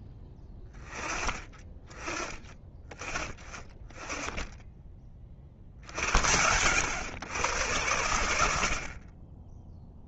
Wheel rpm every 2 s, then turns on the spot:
10, 20, 20, 100, 50.
none